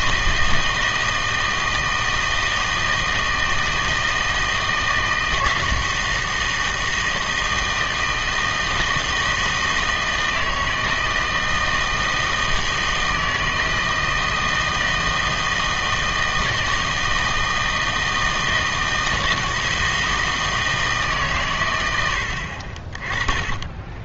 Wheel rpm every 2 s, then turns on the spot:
160, 160, 160, 160, 160, 160, 160, 160, 160, 160, 160, 50.
none